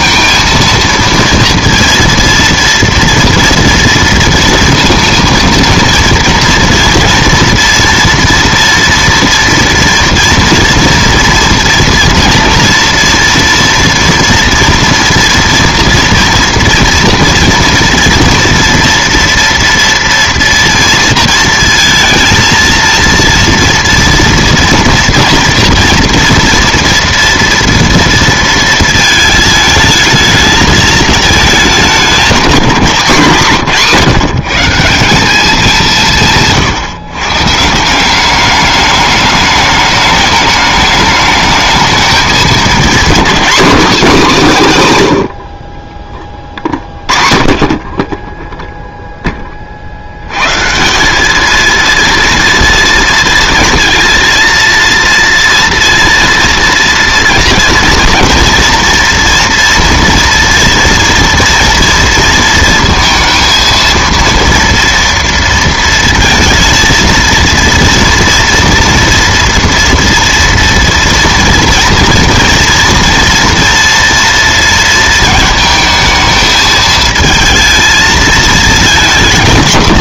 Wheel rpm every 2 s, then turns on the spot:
230, 230, 230, 230, 230, 230, 230, 230, 230, 230, 230, 230, 230, 230, 220, 220, 210, 170, 160, 210, 210, 210, 160, 30, 0, 140, 230, 230, 230, 230, 230, 230, 230, 230, 240, 230, 240, 230, 220, 220.
none